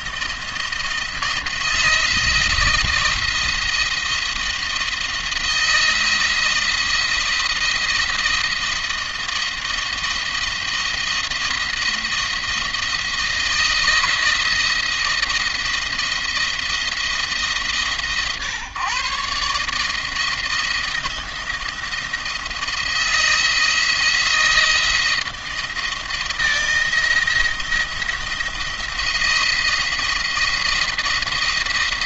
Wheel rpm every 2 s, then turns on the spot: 170, 170, 170, 170, 170, 170, 170, 170, 160, 130, 160, 160, 170, 170, 170, 170.
none